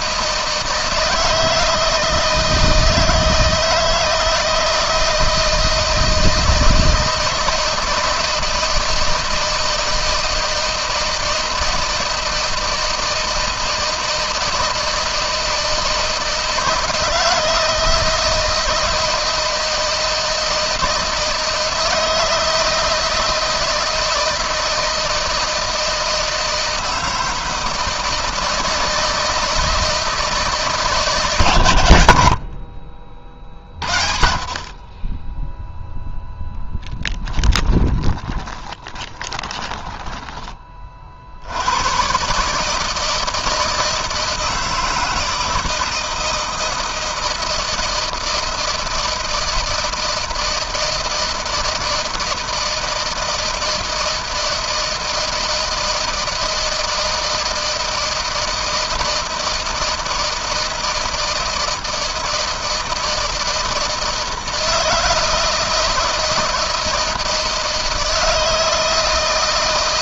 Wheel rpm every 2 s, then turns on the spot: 160, 160, 160, 160, 160, 160, 160, 160, 160, 160, 160, 160, 160, 160, 160, 160, 50, 30, 10, 20, 40, 160, 160, 160, 160, 160, 160, 160, 160, 160, 160, 160, 160, 160, 160.
36-40